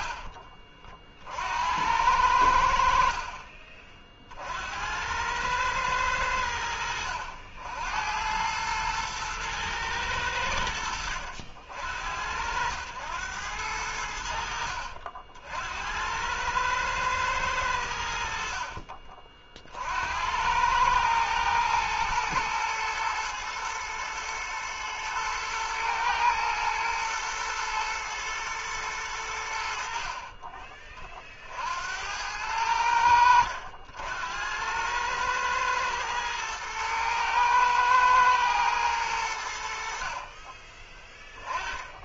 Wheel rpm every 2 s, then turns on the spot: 40, 60, 80, 70, 110, 80, 90, 70, 110, 60, 110, 120, 110, 110, 110, 30, 90, 100, 110, 110, 20.
18-20